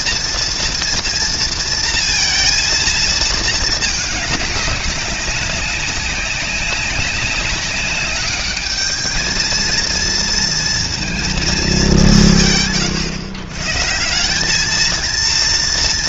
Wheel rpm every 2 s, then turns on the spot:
240, 230, 200, 190, 210, 230, 160, 200.
none